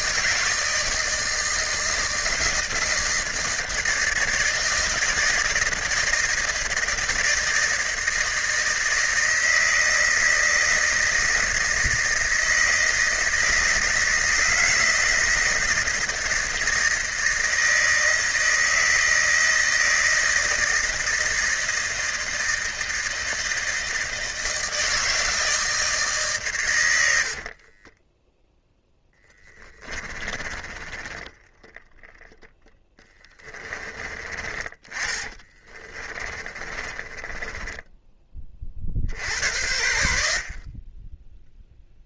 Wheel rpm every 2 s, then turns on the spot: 160, 160, 160, 160, 160, 160, 160, 160, 160, 160, 160, 160, 160, 120, 0, 20, 10, 20, 30, 40, 50.
30-32 34-38